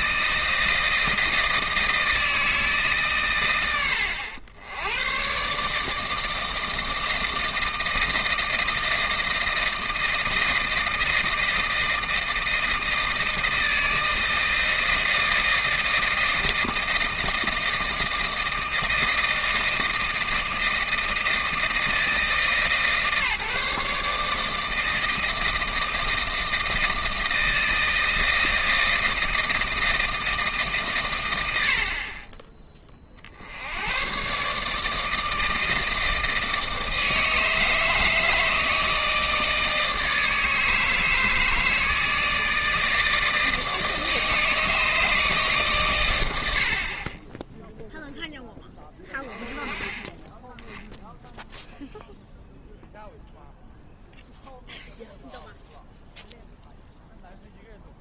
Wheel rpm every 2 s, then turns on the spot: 160, 150, 80, 160, 160, 160, 160, 160, 160, 160, 160, 150, 160, 160, 160, 150, 20, 150, 160, 160, 160, 160, 160, 60, 10, 10, 0, 0, 0.
none